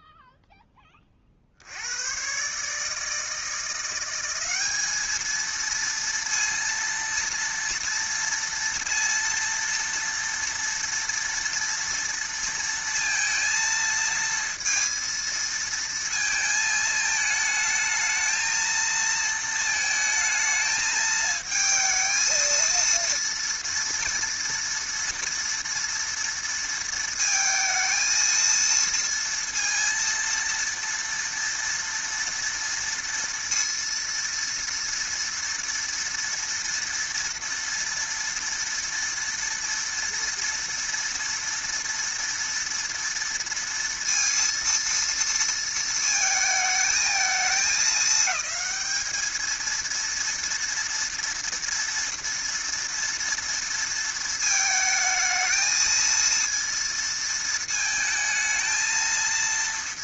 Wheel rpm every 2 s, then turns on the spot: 10, 140, 200, 230, 230, 230, 230, 230, 220, 220, 220, 230, 230, 230, 230, 230, 230, 230, 230, 230, 230, 230, 230, 220, 210, 230, 230, 220, 230, 220.
none